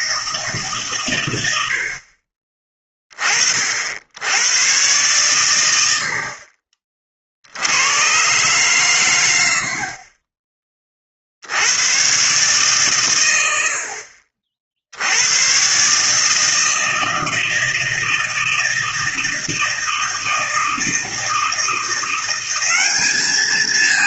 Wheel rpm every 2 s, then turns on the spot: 140, 20, 110, 40, 120, 40, 140, 60, 160, 160, 160, 190.
none